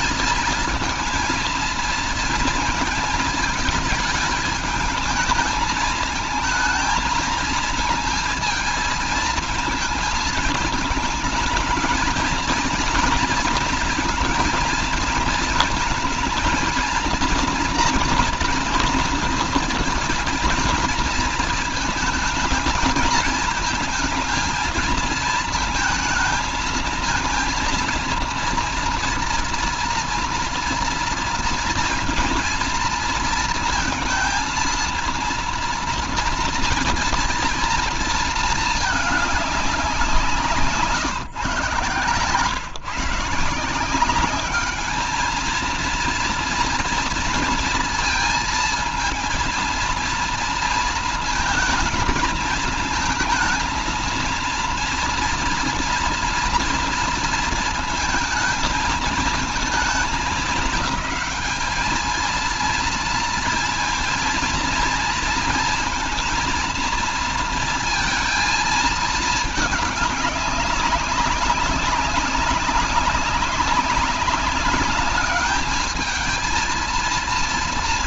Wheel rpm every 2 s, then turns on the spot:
220, 230, 210, 220, 220, 220, 240, 230, 230, 230, 230, 220, 230, 220, 230, 230, 230, 230, 230, 220, 150, 140, 200, 230, 230, 230, 220, 230, 230, 220, 200, 230, 230, 230, 220, 200, 190, 200, 230.
40-42